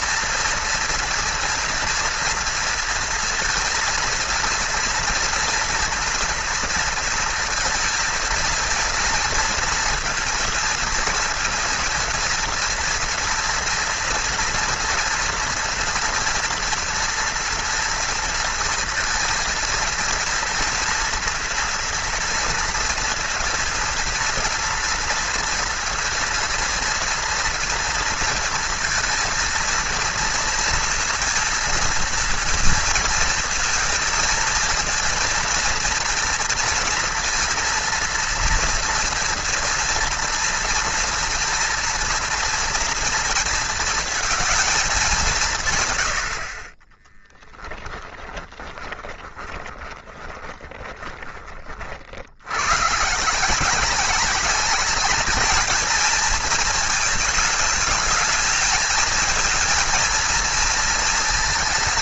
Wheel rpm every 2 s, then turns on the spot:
240, 230, 230, 230, 230, 230, 230, 230, 230, 230, 230, 230, 230, 230, 230, 230, 230, 230, 230, 230, 230, 230, 210, 30, 20, 10, 130, 210, 220, 220, 230.
48-52